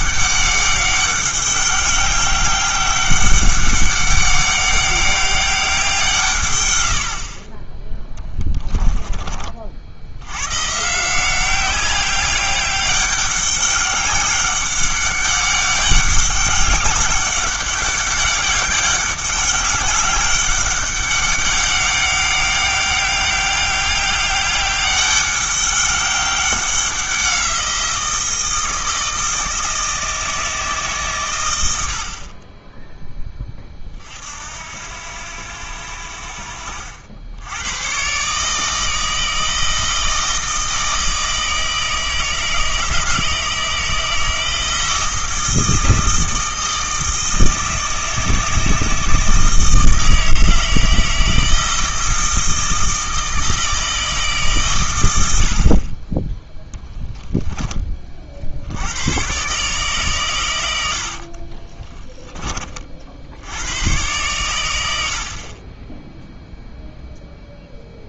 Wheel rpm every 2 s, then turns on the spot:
190, 200, 200, 80, 20, 150, 200, 200, 200, 200, 200, 190, 200, 190, 160, 140, 10, 80, 70, 160, 160, 160, 160, 160, 160, 160, 160, 110, 0, 100, 80, 60, 70, 0.
60-62